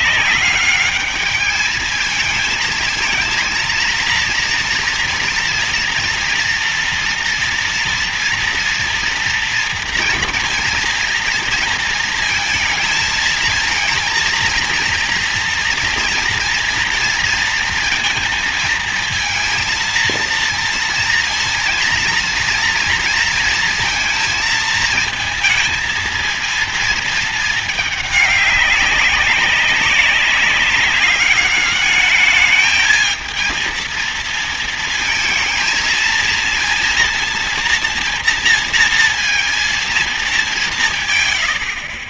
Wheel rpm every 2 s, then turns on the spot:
200, 220, 230, 230, 230, 230, 230, 230, 230, 230, 230, 230, 230, 230, 200, 200, 210, 230, 230, 230, 210.
none